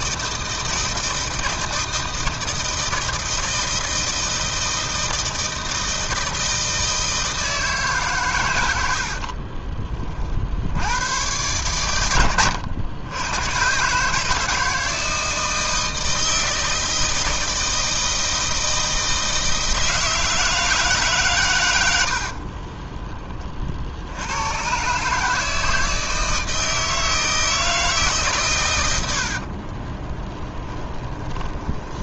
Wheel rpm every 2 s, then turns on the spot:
160, 160, 160, 160, 70, 100, 90, 160, 160, 160, 150, 30, 140, 160, 90, 10.
8-10